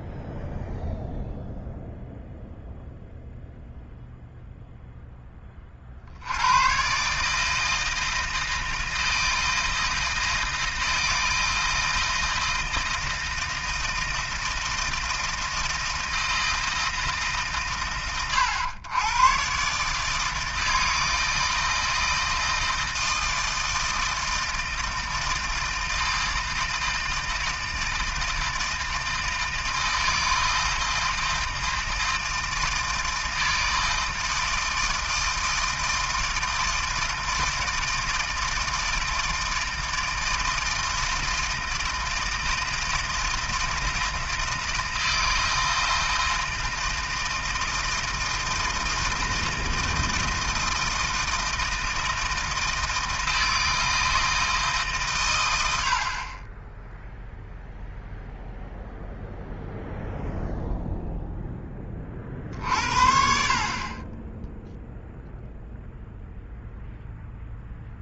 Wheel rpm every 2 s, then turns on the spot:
0, 0, 0, 100, 160, 160, 160, 160, 160, 110, 160, 160, 160, 160, 160, 160, 160, 160, 160, 160, 160, 160, 160, 160, 160, 160, 160, 160, 20, 0, 0, 50, 10, 0.
none